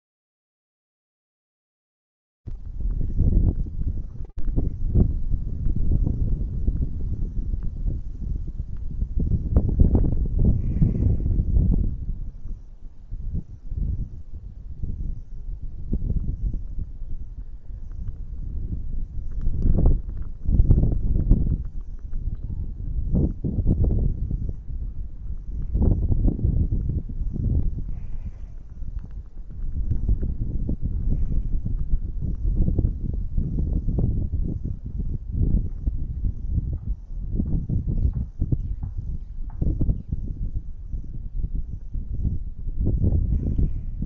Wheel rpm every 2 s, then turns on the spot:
0, 0, 0, 0, 0, 0, 0, 0, 0, 0, 0, 0, 0, 0, 0, 0, 0, 0, 0, 0, 0, 0.
none